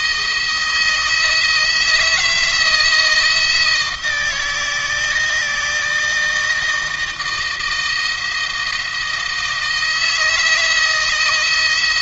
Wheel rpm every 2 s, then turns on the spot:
160, 170, 160, 160, 160, 160.
none